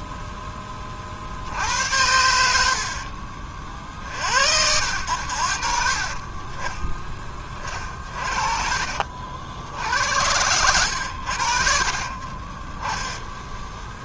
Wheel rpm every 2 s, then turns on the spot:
30, 60, 80, 30, 50, 90, 10.
2-4 8-10